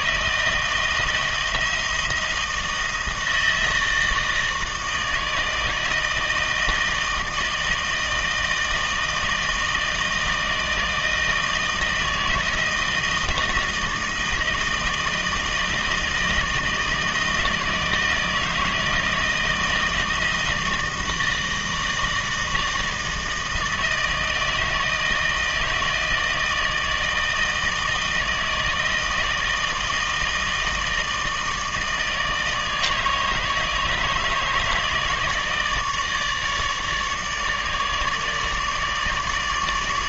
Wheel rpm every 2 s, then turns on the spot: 160, 160, 160, 160, 160, 160, 160, 160, 160, 160, 160, 160, 160, 160, 160, 160, 160, 150, 150, 150.
none